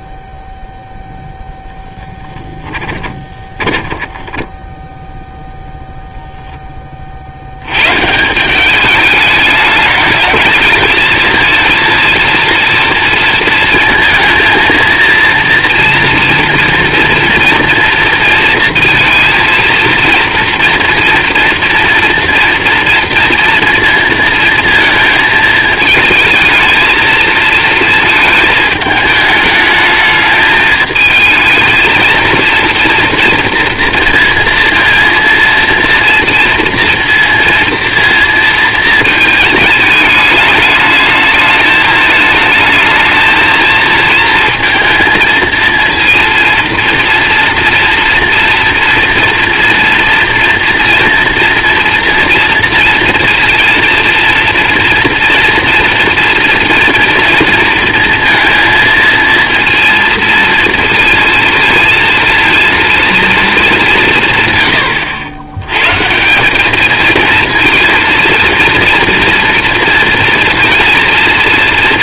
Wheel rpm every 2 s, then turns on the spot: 0, 20, 10, 60, 210, 220, 230, 230, 230, 230, 230, 230, 220, 220, 210, 220, 240, 230, 230, 220, 210, 220, 230, 230, 230, 230, 240, 240, 230, 230, 230, 230, 90, 230, 230, 230.
2-4